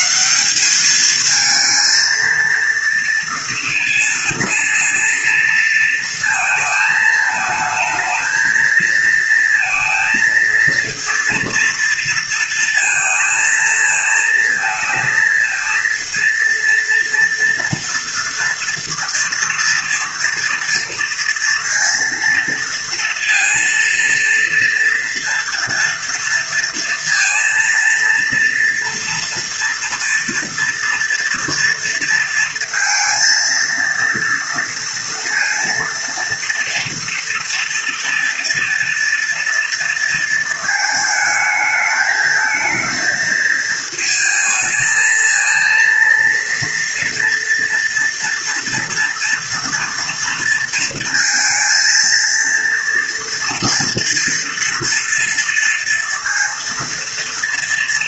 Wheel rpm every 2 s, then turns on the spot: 210, 230, 230, 220, 220, 230, 230, 230, 230, 230, 230, 230, 230, 230, 230, 230, 230, 230, 230, 230, 220, 220, 220, 230, 240, 230, 230, 230, 220.
none